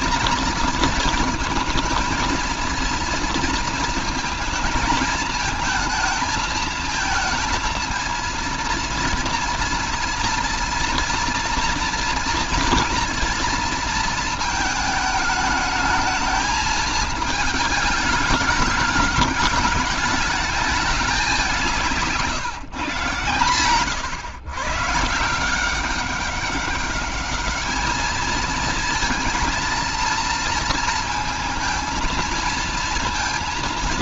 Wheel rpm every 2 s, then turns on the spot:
230, 230, 220, 230, 230, 230, 230, 220, 220, 210, 210, 130, 140, 200, 230, 230, 230.
none